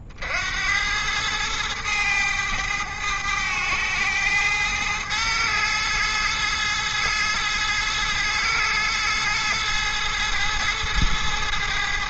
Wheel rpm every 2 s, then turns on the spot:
90, 100, 110, 110, 110, 110.
none